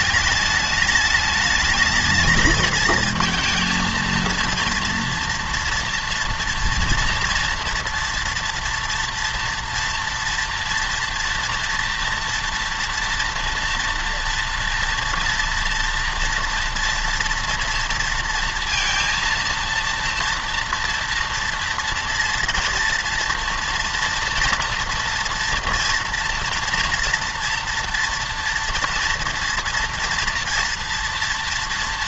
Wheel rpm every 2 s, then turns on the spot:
210, 220, 230, 230, 230, 230, 230, 230, 230, 230, 230, 230, 240, 230, 230, 230.
none